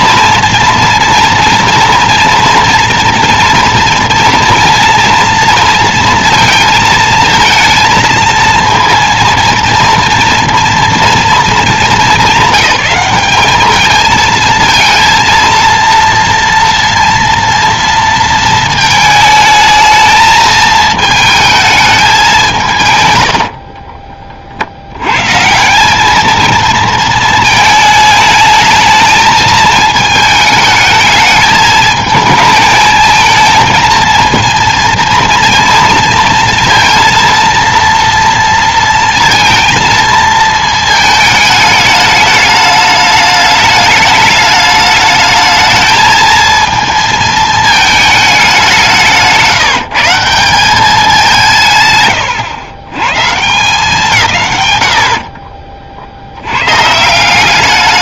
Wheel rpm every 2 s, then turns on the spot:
230, 240, 230, 230, 230, 230, 190, 230, 230, 230, 220, 170, 50, 220, 220, 220, 220, 230, 230, 230, 220, 210, 210, 230, 190, 190, 90, 140, 110.
52-54